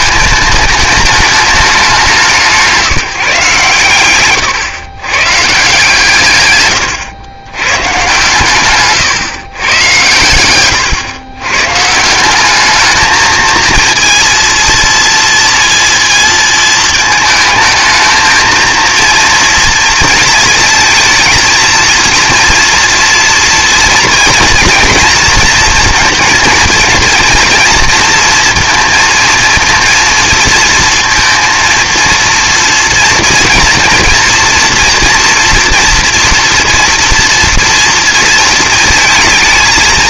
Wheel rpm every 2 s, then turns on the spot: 220, 170, 120, 120, 140, 120, 210, 230, 220, 230, 220, 230, 230, 230, 230, 230, 230, 230, 240, 230.
none